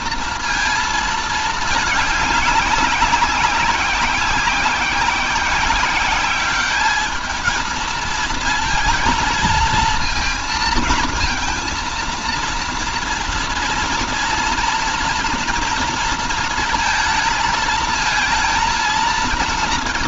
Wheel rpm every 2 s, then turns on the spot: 230, 200, 190, 210, 220, 230, 230, 230, 220, 230.
none